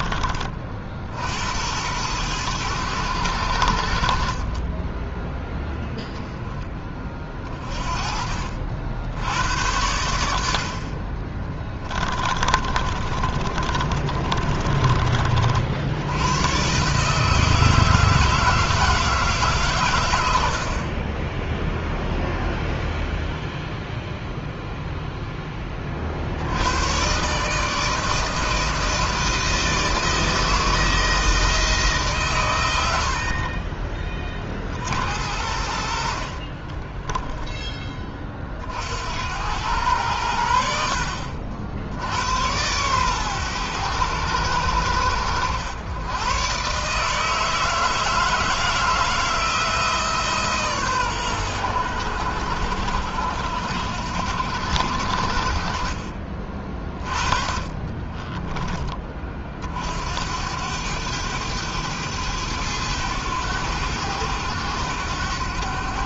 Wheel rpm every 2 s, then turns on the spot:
40, 100, 40, 10, 50, 70, 30, 30, 110, 160, 60, 0, 0, 90, 160, 160, 110, 40, 40, 40, 80, 100, 90, 130, 160, 140, 80, 70, 30, 30, 80, 110, 100.
12-16 36-38